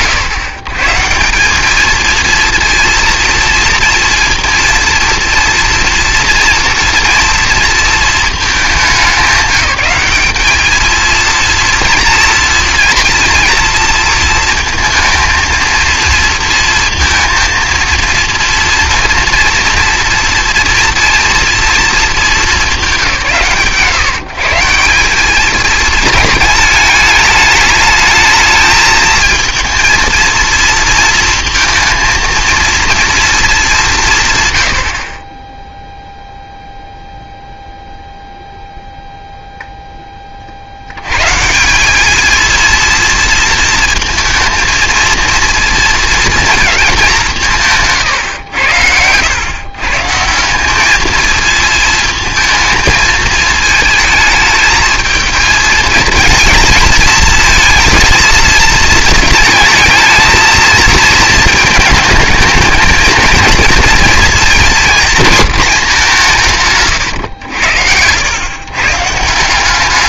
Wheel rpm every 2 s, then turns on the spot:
130, 230, 230, 230, 210, 210, 240, 230, 230, 230, 230, 220, 160, 220, 220, 230, 230, 120, 0, 0, 50, 230, 230, 220, 110, 190, 220, 220, 230, 230, 230, 220, 230, 170, 100.
none